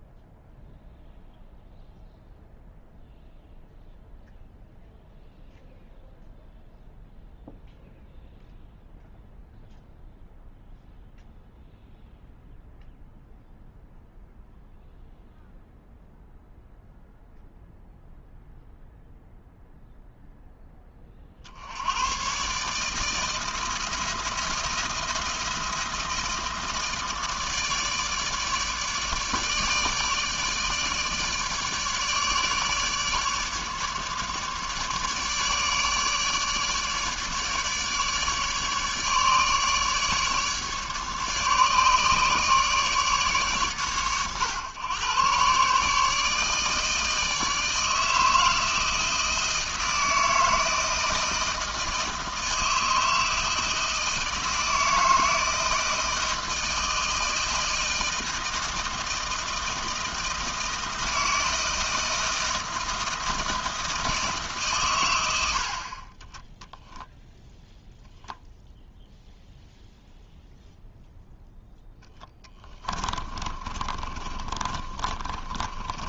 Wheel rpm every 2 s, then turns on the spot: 0, 0, 0, 0, 0, 0, 0, 0, 0, 0, 20, 150, 160, 160, 150, 150, 150, 150, 150, 150, 150, 150, 120, 150, 160, 160, 160, 160, 160, 160, 160, 160, 120, 10, 0, 0, 10, 30.
66-68 72-76